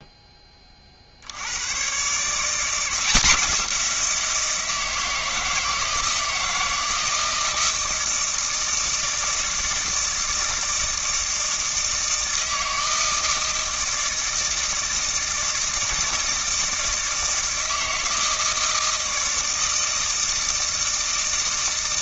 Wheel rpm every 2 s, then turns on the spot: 20, 170, 160, 160, 160, 160, 160, 160, 160, 160, 160.
none